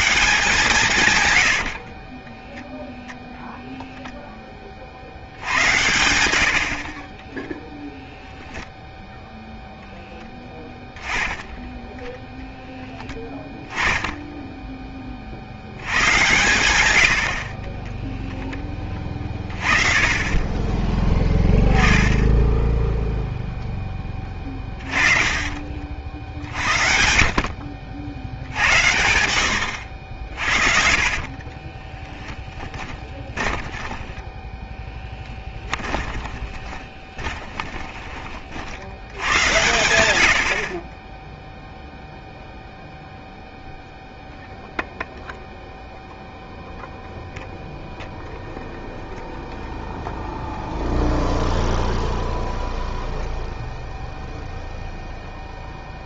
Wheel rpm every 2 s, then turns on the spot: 160, 10, 20, 70, 0, 10, 0, 10, 110, 10, 20, 10, 30, 60, 80, 50, 10, 10, 20, 50, 60, 0, 0, 0, 0, 0, 0, 0.
2-4 24-26 30-38